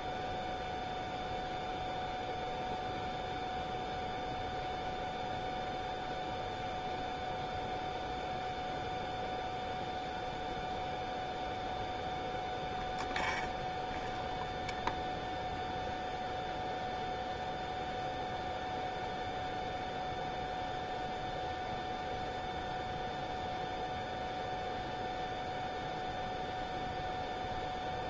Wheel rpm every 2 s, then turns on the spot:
0, 0, 0, 0, 0, 0, 0, 0, 0, 0, 0, 0, 0, 0.
none